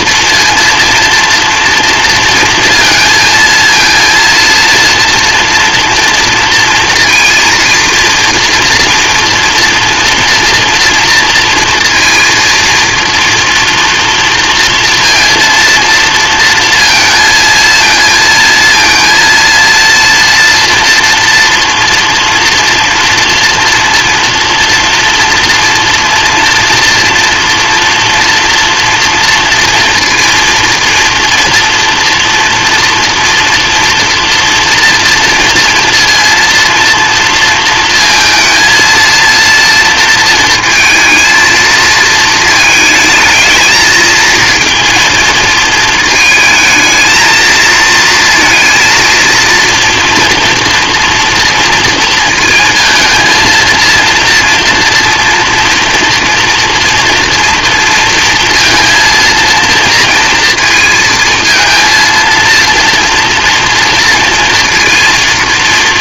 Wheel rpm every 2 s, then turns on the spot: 230, 230, 230, 230, 230, 230, 230, 230, 230, 230, 230, 230, 230, 230, 230, 230, 230, 240, 230, 230, 220, 220, 230, 220, 230, 230, 230, 230, 230, 230, 230, 230, 230.
none